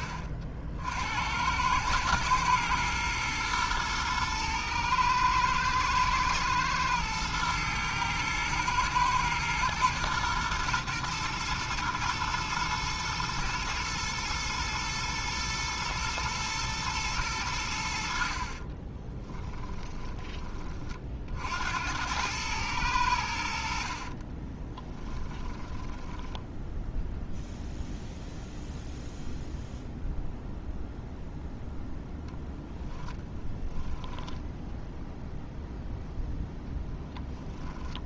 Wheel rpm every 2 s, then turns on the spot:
60, 110, 110, 110, 110, 120, 120, 120, 110, 30, 40, 100, 20, 0, 0, 0, 0, 0, 0.
18-20 24-26